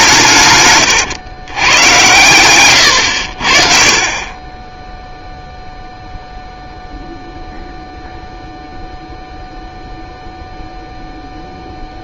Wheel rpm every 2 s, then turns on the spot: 120, 110, 10, 0, 0, 0.
none